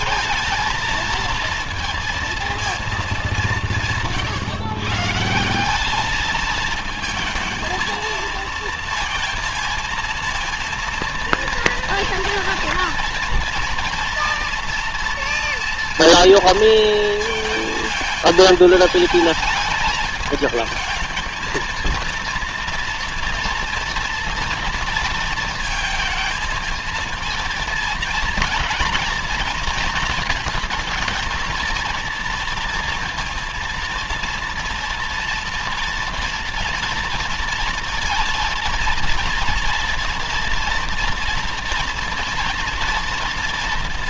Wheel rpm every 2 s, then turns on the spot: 220, 220, 130, 220, 230, 230, 230, 230, 230, 220, 220, 230, 230, 220, 230, 230, 230, 230, 230, 230, 230, 230.
none